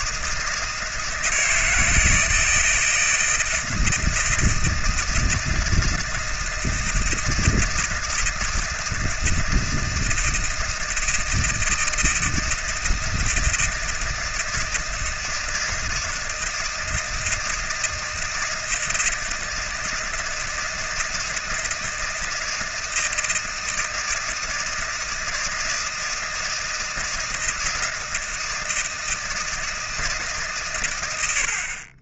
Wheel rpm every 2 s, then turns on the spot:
160, 160, 160, 160, 160, 160, 160, 160, 160, 160, 160, 160, 160, 160, 160, 110.
none